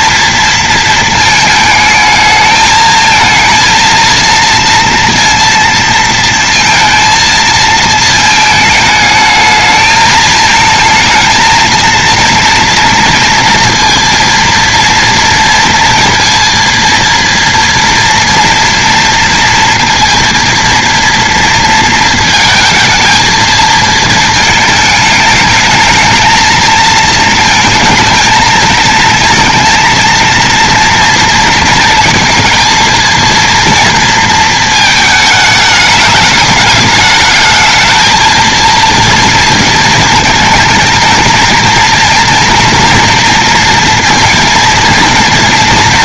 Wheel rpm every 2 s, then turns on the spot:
230, 220, 230, 230, 220, 220, 230, 230, 230, 230, 230, 230, 220, 220, 220, 230, 230, 230, 210, 220, 220, 230, 230.
none